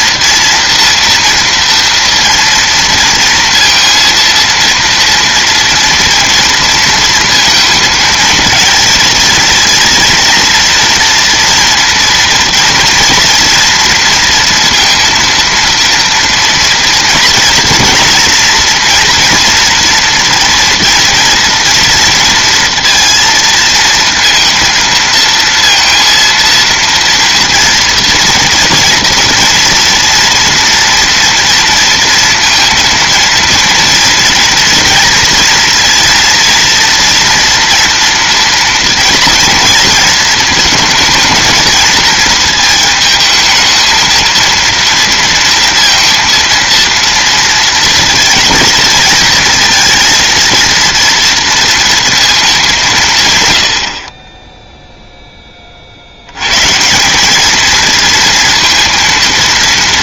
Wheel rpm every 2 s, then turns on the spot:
230, 230, 230, 230, 230, 240, 240, 230, 230, 230, 230, 230, 230, 230, 230, 230, 230, 240, 230, 230, 220, 220, 230, 230, 230, 230, 170, 0, 150, 230.
none